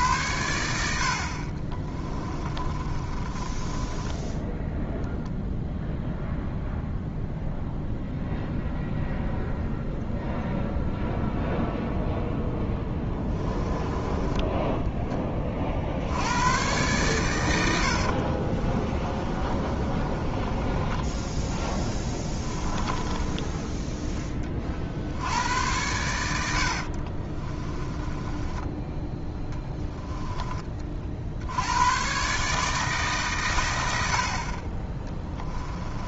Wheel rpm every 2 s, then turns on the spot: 80, 30, 0, 0, 0, 0, 10, 10, 110, 30, 20, 20, 40, 60, 10, 30, 150, 40.
2-4 12-14 18-24 26-30